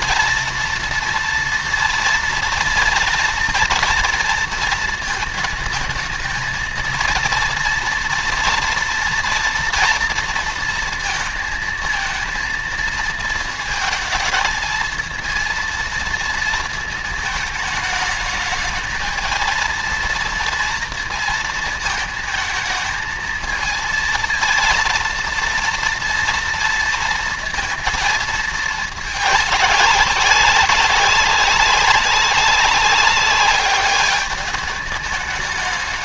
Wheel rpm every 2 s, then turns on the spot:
230, 230, 220, 230, 240, 230, 220, 220, 220, 220, 230, 220, 230, 230, 210, 200, 190, 210.
none